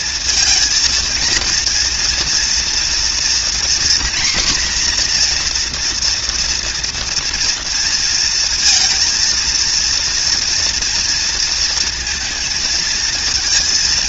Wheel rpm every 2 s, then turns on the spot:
230, 230, 250, 240, 230, 230, 230.
none